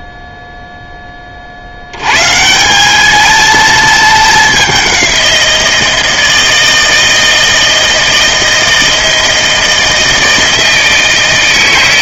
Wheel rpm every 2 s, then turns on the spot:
0, 160, 200, 160, 160, 160.
none